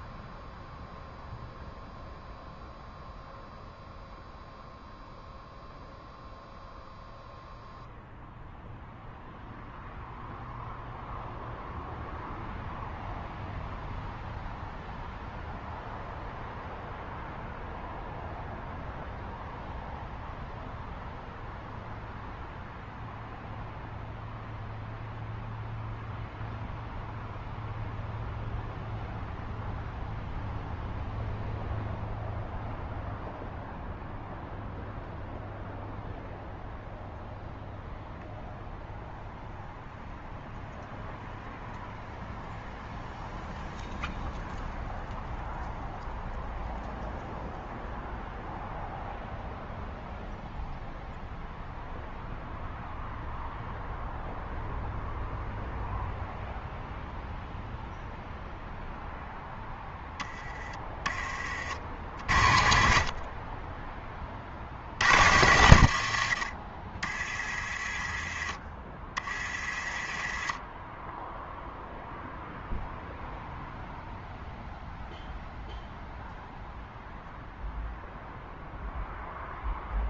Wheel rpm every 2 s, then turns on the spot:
0, 0, 0, 0, 0, 0, 0, 0, 0, 0, 0, 0, 0, 0, 0, 0, 0, 0, 0, 0, 0, 0, 0, 0, 0, 0, 0, 0, 0, 0, 20, 70, 80, 60, 30, 20, 0, 0, 0, 0.
66-68